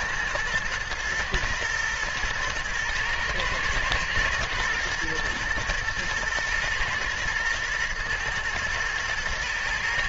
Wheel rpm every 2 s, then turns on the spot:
120, 120, 120, 110, 110.
none